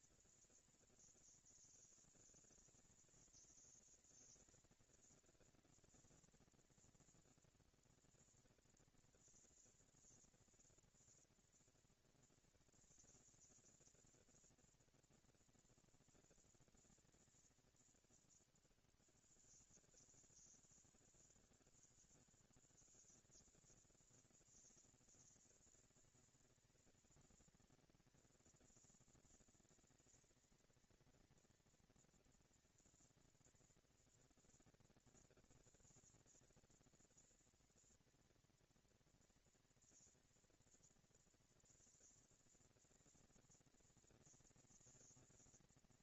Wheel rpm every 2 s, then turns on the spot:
210, 190, 230, 230, 230, 240, 230, 230, 230, 190, 160, 170, 220, 230, 230, 230, 230, 230, 230, 230, 230, 230, 230.
none